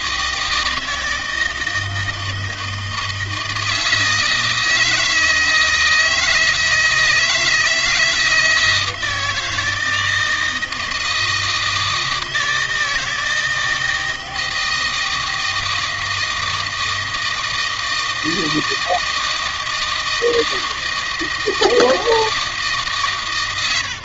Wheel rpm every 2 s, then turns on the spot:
160, 160, 160, 160, 160, 160, 160, 160, 160, 160, 160, 150.
none